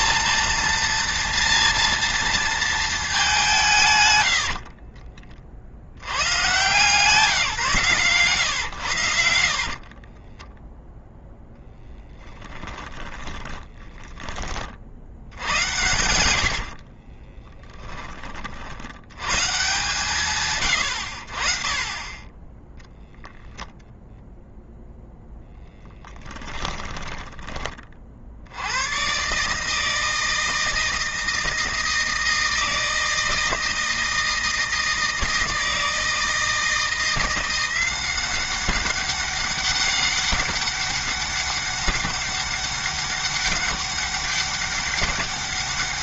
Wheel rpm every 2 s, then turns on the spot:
230, 220, 60, 140, 110, 10, 20, 60, 70, 80, 90, 0, 0, 10, 90, 160, 160, 160, 160, 190, 200, 200, 200.
4-6 10-14 16-18 26-28